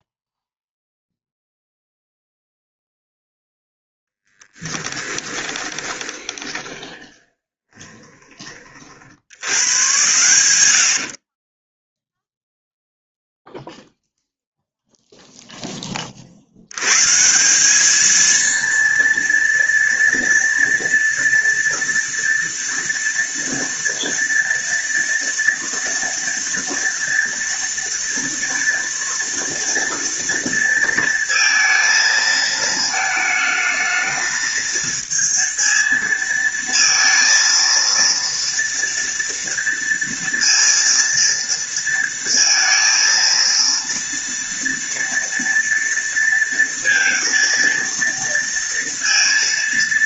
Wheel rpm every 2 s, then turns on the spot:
0, 0, 10, 20, 50, 70, 0, 0, 130, 230, 230, 230, 230, 230, 230, 230, 220, 220, 230, 230, 230, 230, 230, 230, 230.
4-8 10-12